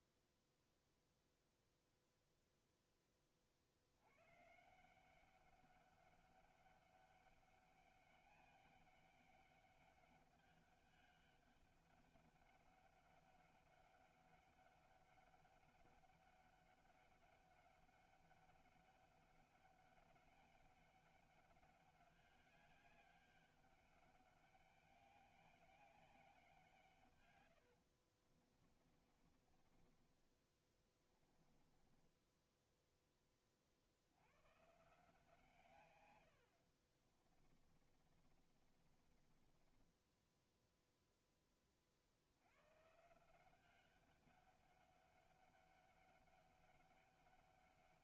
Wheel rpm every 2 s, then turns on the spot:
0, 0, 150, 200, 200, 200, 200, 200, 200, 200, 200, 200, 200, 170, 30, 20, 10, 140, 70, 40, 0, 110, 200, 200.
28-34 36-40